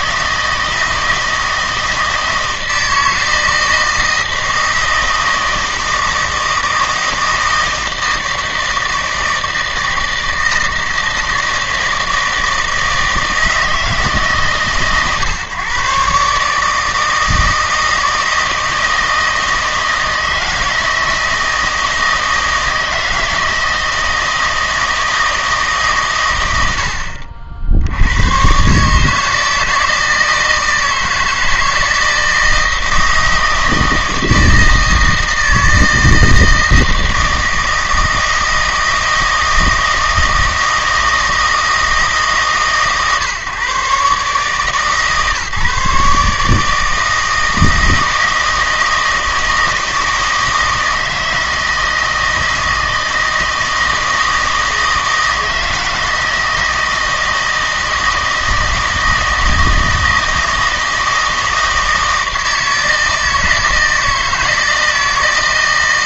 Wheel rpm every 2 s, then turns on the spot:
160, 160, 160, 160, 160, 160, 160, 140, 150, 160, 160, 160, 160, 70, 130, 160, 160, 160, 160, 160, 160, 140, 150, 150, 160, 160, 160, 160, 160, 160, 160, 160, 160.
none